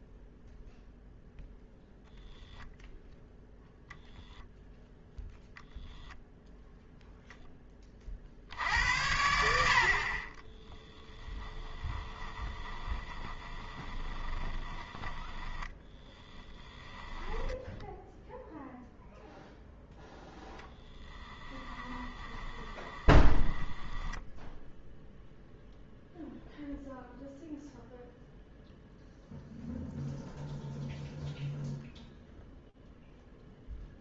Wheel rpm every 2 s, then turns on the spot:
0, 0, 0, 0, 70, 10, 20, 20, 10, 0, 0, 20, 0, 0, 0, 0, 0.
10-18 22-24